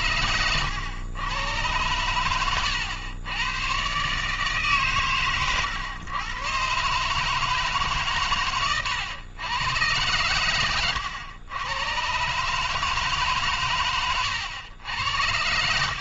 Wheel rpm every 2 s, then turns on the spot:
100, 110, 140, 120, 130, 120, 120, 110.
none